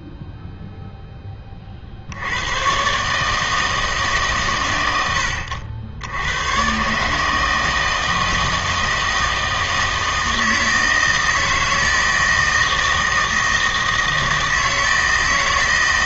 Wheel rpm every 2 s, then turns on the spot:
0, 110, 110, 120, 160, 160, 160, 160.
none